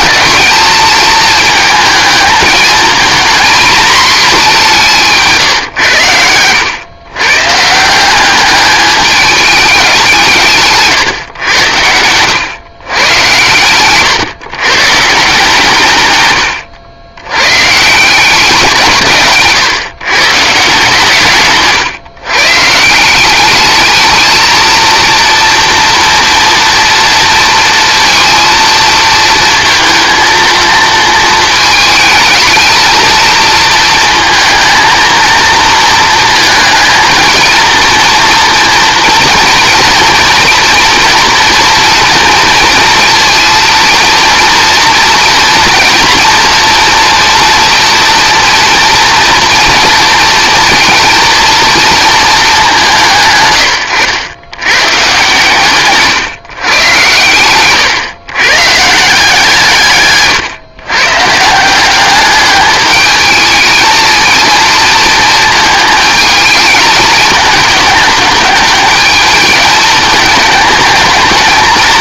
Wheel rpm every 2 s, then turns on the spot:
220, 220, 180, 110, 210, 140, 120, 150, 100, 160, 140, 160, 230, 230, 230, 220, 220, 230, 220, 230, 230, 230, 230, 230, 230, 230, 170, 130, 120, 150, 130, 210, 230, 220, 220, 210.
none